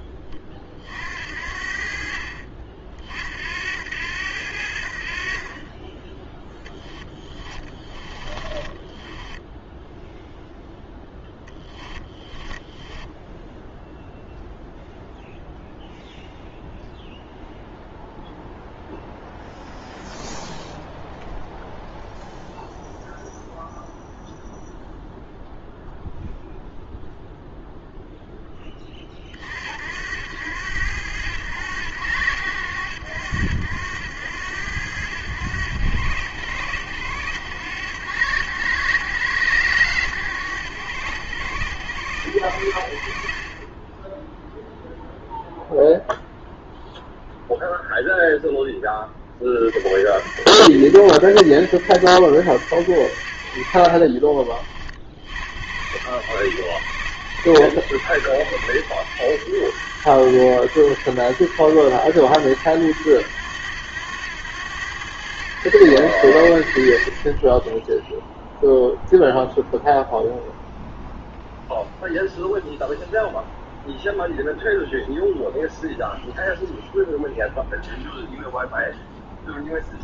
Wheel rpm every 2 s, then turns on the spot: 0, 50, 80, 0, 20, 0, 20, 0, 0, 0, 0, 0, 0, 0, 10, 80, 70, 90, 80, 90, 90, 80, 0, 0, 0, 70, 80, 40, 70, 80, 80, 90, 90, 70, 0, 0, 0, 0, 0, 0.
8-10 12-14